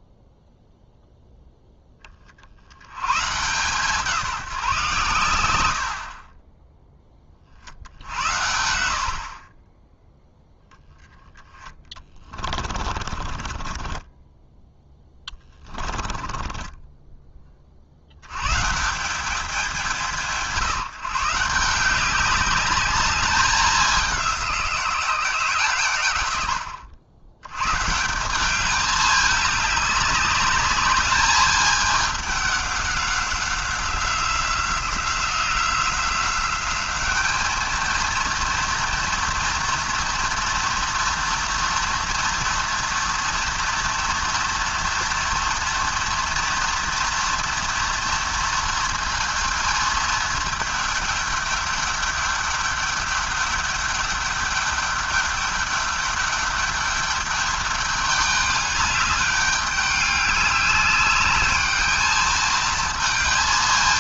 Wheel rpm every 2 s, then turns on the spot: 0, 90, 150, 10, 70, 0, 30, 10, 20, 140, 160, 200, 180, 90, 200, 210, 190, 180, 200, 230, 230, 230, 230, 230, 230, 220, 210, 210, 210, 200, 200, 220.
12-18